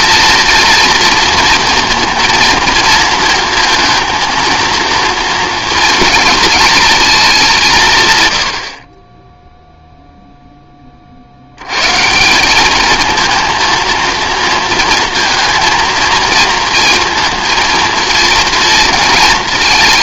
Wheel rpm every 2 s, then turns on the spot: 230, 230, 230, 220, 90, 10, 200, 230, 230, 220.
none